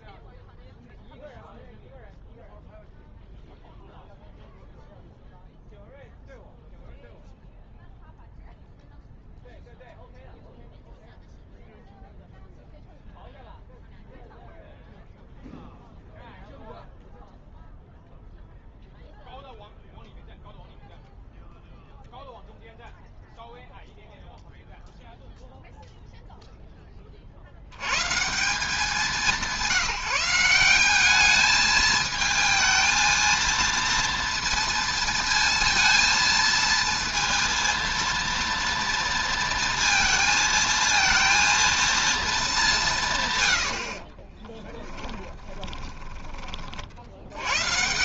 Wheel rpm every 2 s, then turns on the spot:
0, 0, 0, 0, 0, 0, 0, 0, 0, 0, 0, 0, 0, 10, 180, 190, 220, 230, 230, 240, 230, 200, 20, 40.
44-46